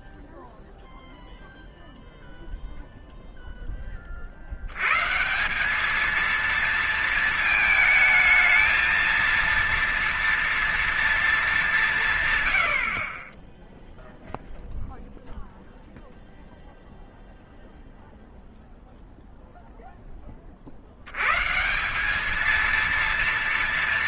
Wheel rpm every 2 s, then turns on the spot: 0, 0, 130, 230, 230, 220, 50, 0, 0, 0, 70, 220.
none